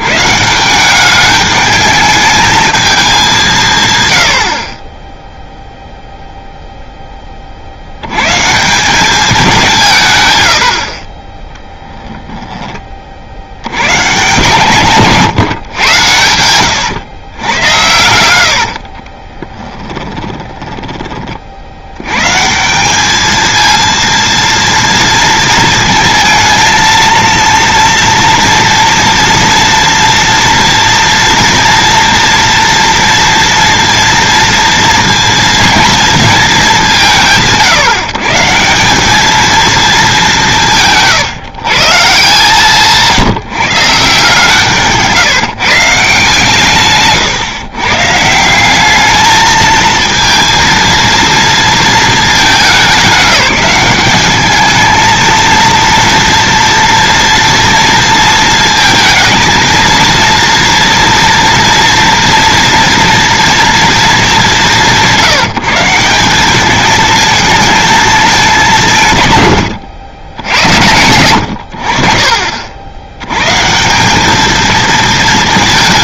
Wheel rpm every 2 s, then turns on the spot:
170, 220, 50, 0, 160, 70, 20, 150, 90, 70, 20, 160, 230, 230, 230, 230, 230, 230, 200, 160, 170, 160, 150, 130, 180, 230, 190, 210, 230, 230, 230, 230, 190, 210, 190, 80, 50, 220.
16-20